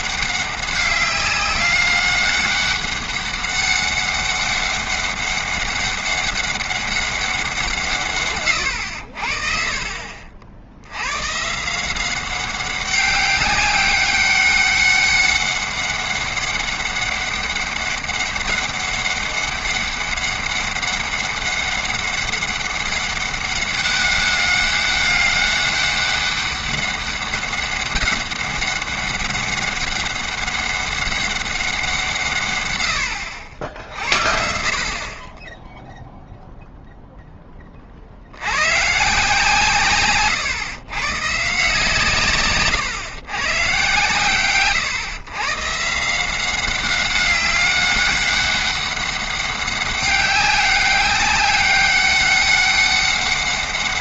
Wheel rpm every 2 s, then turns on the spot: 190, 200, 200, 200, 110, 70, 190, 190, 200, 200, 200, 200, 200, 200, 200, 200, 110, 50, 0, 110, 120, 120, 130, 190, 200, 200, 200.
none